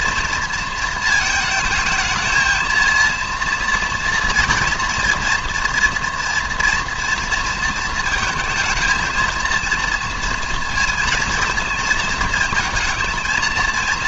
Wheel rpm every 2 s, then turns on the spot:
230, 220, 240, 240, 230, 230, 220.
none